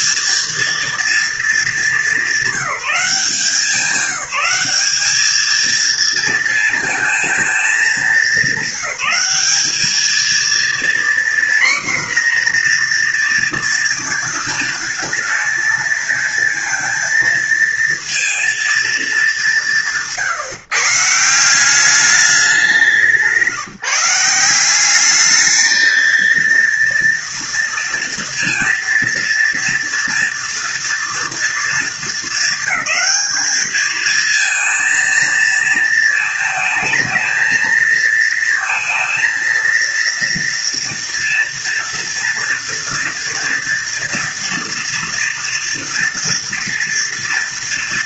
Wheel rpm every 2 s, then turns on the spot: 230, 190, 200, 230, 200, 240, 240, 230, 230, 220, 150, 180, 190, 230, 230, 240, 220, 230, 220, 230, 230, 230, 230, 230.
none